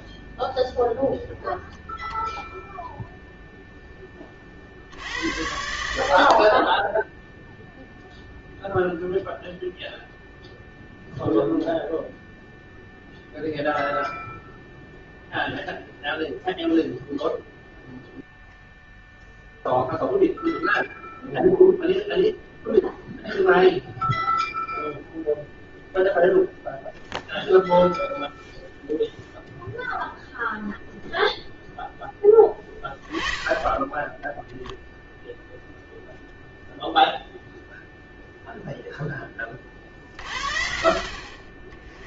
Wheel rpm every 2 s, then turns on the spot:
0, 0, 50, 30, 0, 10, 0, 0, 0, 0, 0, 0, 0, 0, 0, 0, 10, 0, 0, 0, 50.
none